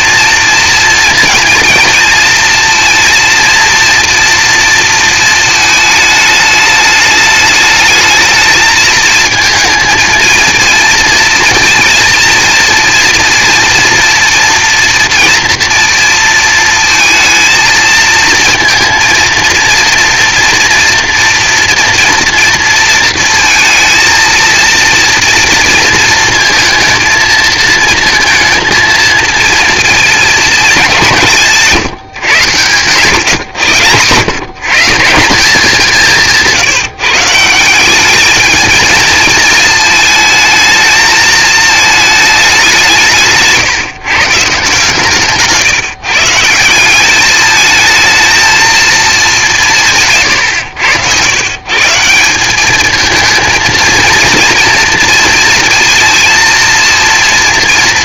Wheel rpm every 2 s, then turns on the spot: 230, 230, 230, 210, 220, 230, 230, 230, 230, 230, 230, 230, 230, 230, 230, 210, 120, 130, 160, 220, 220, 190, 150, 180, 230, 110, 210, 230, 230.
none